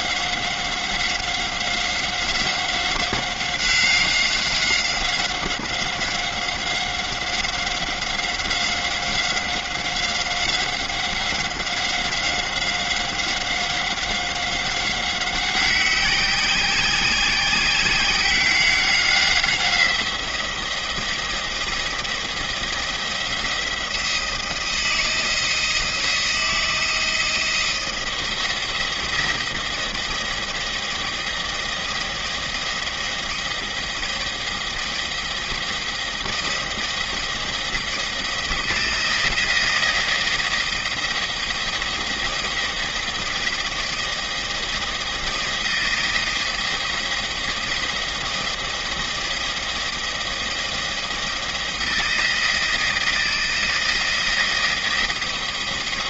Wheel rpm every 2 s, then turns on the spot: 190, 190, 190, 190, 180, 190, 190, 190, 190, 190, 170, 170, 160, 170, 160, 170, 160, 160, 160, 160, 160, 160, 160, 170, 170, 170, 160, 160.
none